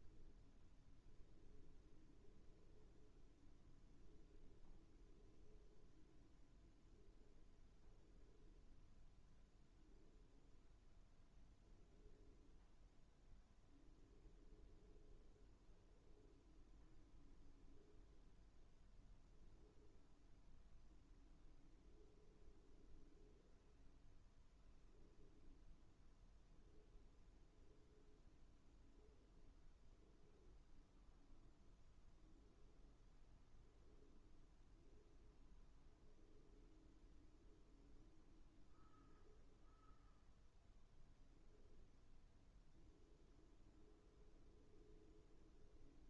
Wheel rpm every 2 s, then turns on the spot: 0, 0, 0, 0, 0, 0, 0, 0, 0, 0, 0, 0, 0, 0, 0, 0, 0, 0, 0, 0, 0, 0, 0.
none